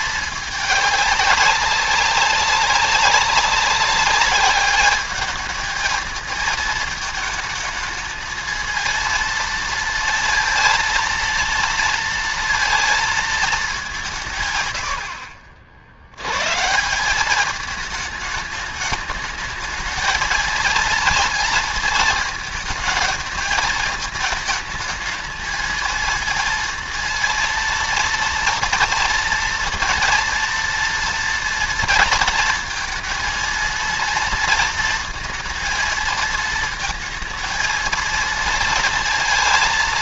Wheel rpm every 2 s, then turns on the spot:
210, 190, 210, 220, 230, 230, 230, 100, 160, 210, 230, 220, 220, 230, 230, 230, 230, 230, 230, 230.
none